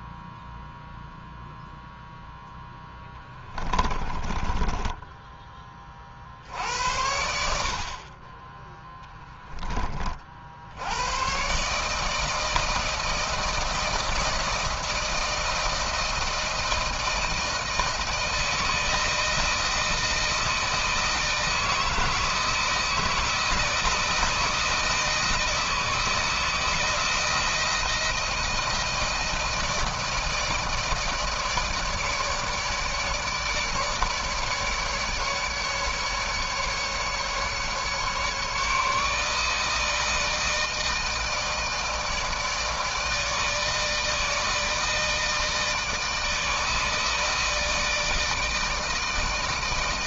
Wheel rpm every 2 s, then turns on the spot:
0, 10, 20, 70, 10, 80, 160, 160, 160, 170, 160, 160, 160, 160, 160, 160, 160, 150, 150, 160, 160, 160, 160, 160, 160.
2-6